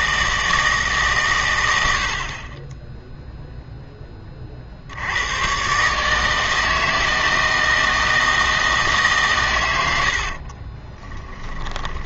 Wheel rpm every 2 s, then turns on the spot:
160, 20, 50, 160, 160, 40.
10-12